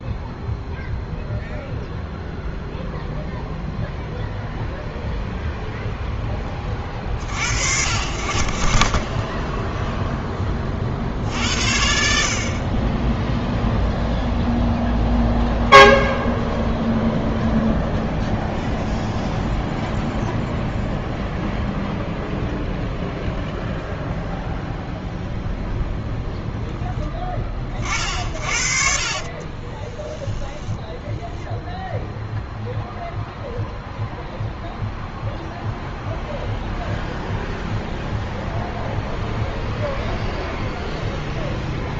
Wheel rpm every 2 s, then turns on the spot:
0, 0, 0, 30, 50, 40, 30, 0, 0, 0, 0, 0, 0, 10, 60, 10, 0, 0, 0, 0, 0.
30-32